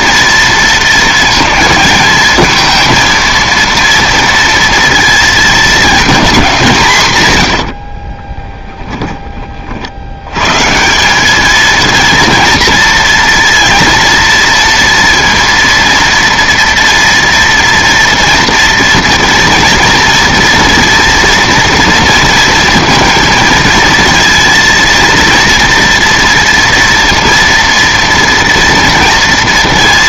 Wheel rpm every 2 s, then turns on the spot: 230, 220, 230, 190, 10, 150, 230, 230, 230, 230, 230, 230, 230, 230, 230.
8-10